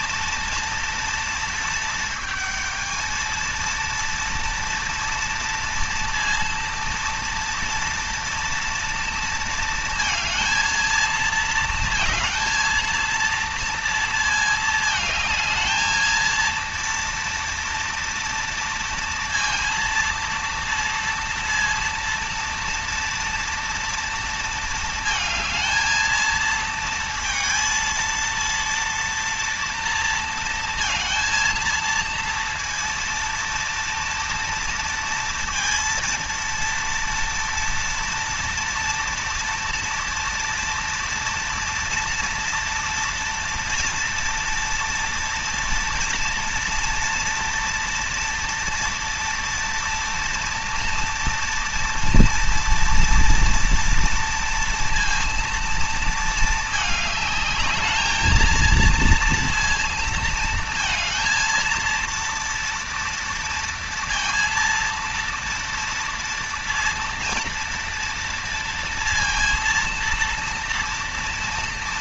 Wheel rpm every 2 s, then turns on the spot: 230, 220, 230, 230, 230, 230, 230, 220, 230, 230, 230, 230, 220, 230, 230, 220, 230, 230, 230, 240, 230, 230, 230, 230, 230, 230, 230, 230, 220, 230, 230, 230, 230, 230, 230, 230.
none